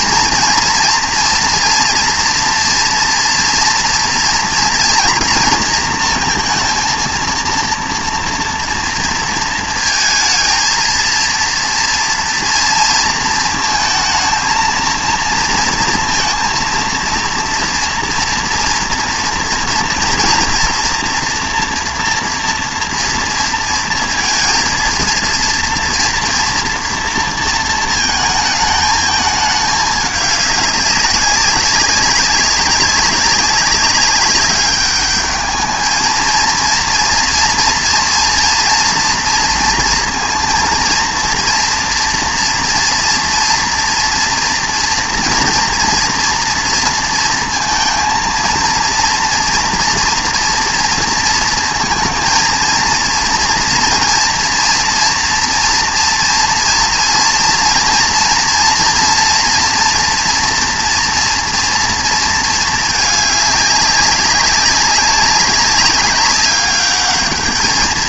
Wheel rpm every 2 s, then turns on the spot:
240, 240, 240, 230, 230, 230, 230, 230, 230, 230, 230, 230, 230, 230, 220, 200, 190, 200, 230, 240, 230, 230, 230, 230, 230, 230, 230, 230, 240, 230, 240, 220, 190, 200.
none